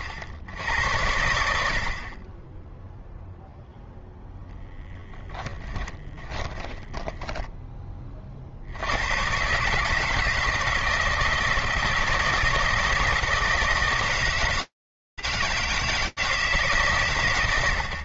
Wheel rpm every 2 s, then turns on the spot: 90, 10, 10, 20, 110, 160, 160, 160, 160.
4-8